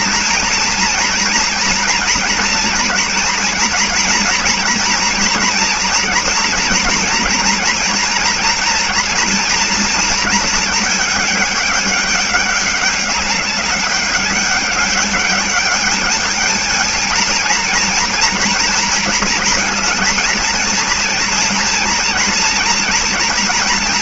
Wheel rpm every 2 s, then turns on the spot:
230, 230, 240, 230, 230, 230, 200, 200, 220, 230, 230, 230.
none